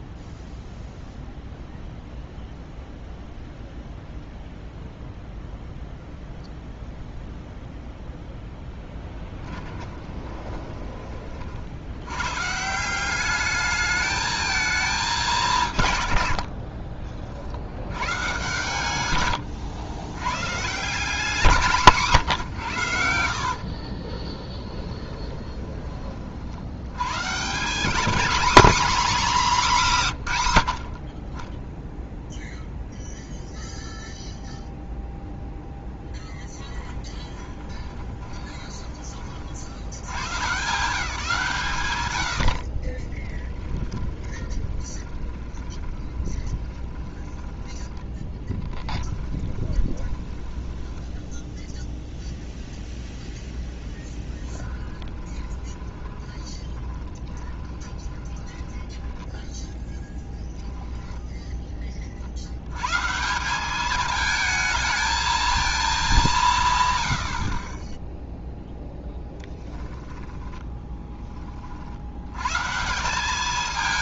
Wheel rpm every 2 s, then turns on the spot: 0, 0, 0, 0, 10, 20, 170, 220, 50, 110, 160, 90, 10, 90, 250, 90, 0, 0, 10, 20, 160, 50, 20, 20, 20, 20, 0, 20, 20, 10, 10, 110, 220, 130, 0, 10, 150.
16-18 24-26 36-38 42-52 54-60